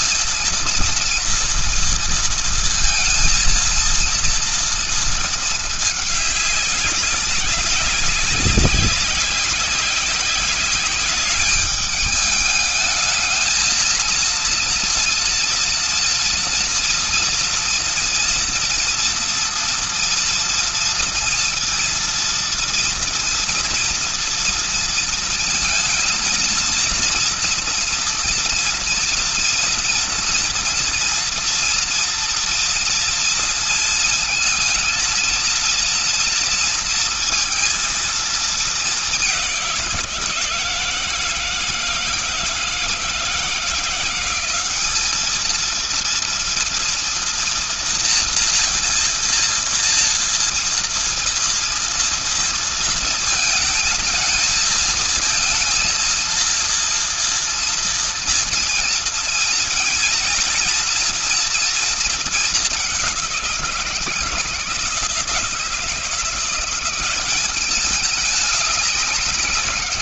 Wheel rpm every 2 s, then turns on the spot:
230, 230, 220, 200, 190, 200, 220, 230, 230, 230, 230, 230, 230, 230, 240, 230, 230, 220, 230, 210, 160, 170, 200, 230, 230, 230, 230, 220, 230, 230, 230, 210, 160, 170, 210.
none